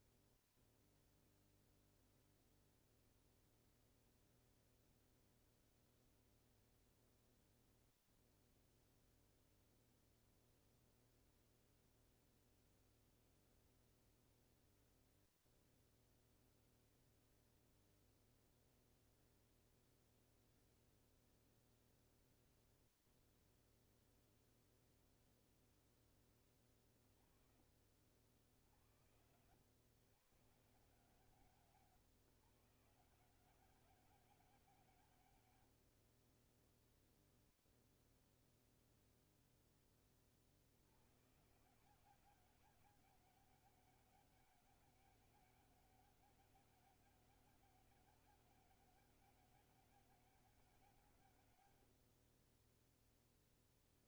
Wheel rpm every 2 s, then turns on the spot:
0, 0, 0, 0, 0, 0, 0, 0, 0, 0, 0, 0, 0, 20, 70, 140, 140, 190, 30, 0, 40, 190, 200, 200, 200, 190, 40.
none